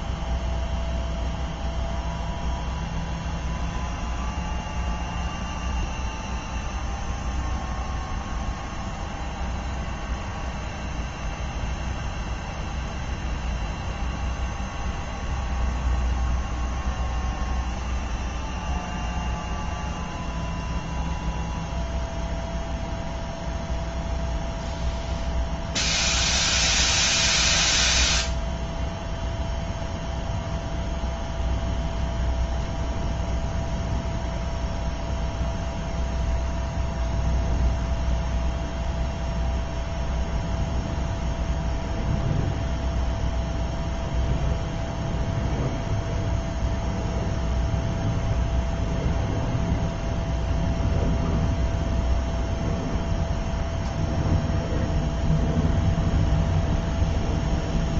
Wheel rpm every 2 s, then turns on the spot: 0, 0, 0, 0, 0, 0, 0, 0, 0, 0, 0, 0, 0, 0, 0, 0, 0, 0, 0, 0, 0, 0, 0, 0, 0, 0, 0, 0, 0.
none